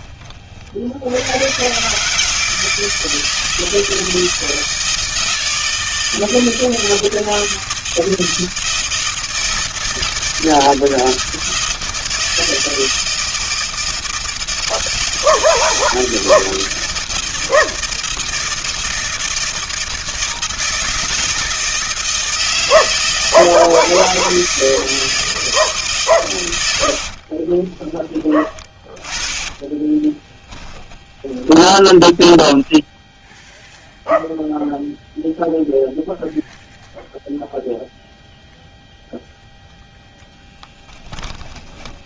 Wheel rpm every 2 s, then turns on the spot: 30, 160, 160, 160, 160, 160, 160, 160, 160, 160, 160, 160, 160, 110, 20, 20, 20, 0, 0, 0, 10.
28-34 40-42